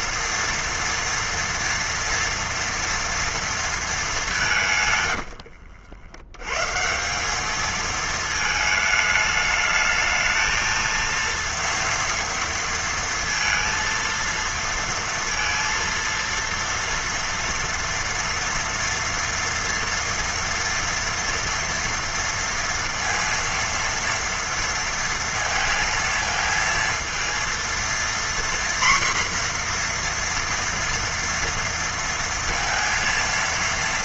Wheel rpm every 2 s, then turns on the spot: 230, 230, 150, 140, 220, 220, 230, 230, 230, 230, 230, 230, 230, 230, 240, 240, 230.
none